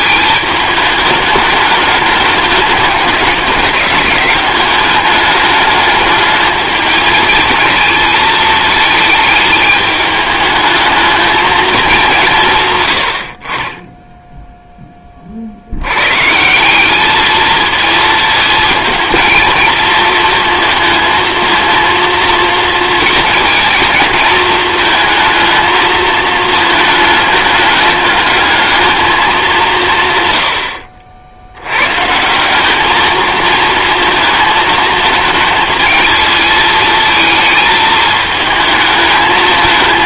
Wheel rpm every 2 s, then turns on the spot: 210, 200, 200, 220, 220, 220, 130, 10, 190, 220, 230, 220, 220, 220, 220, 70, 200, 220, 220, 220.
none